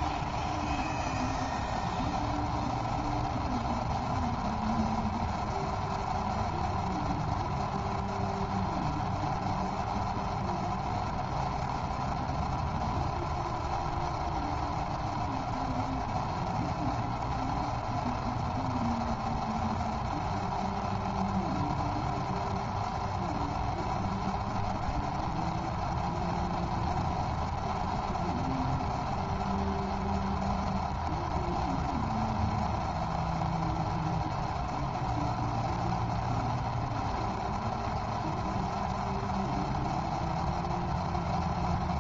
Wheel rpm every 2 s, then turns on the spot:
0, 0, 0, 0, 0, 0, 0, 0, 0, 0, 0, 0, 0, 0, 0, 0, 0, 0, 0, 0, 0.
none